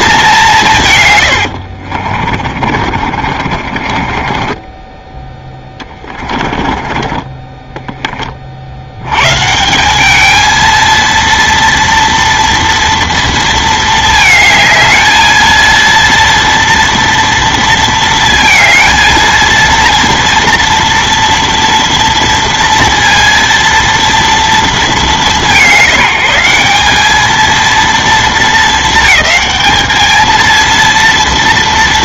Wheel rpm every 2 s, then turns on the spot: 180, 40, 20, 30, 50, 220, 230, 220, 230, 230, 230, 230, 220, 190, 210, 230.
2-8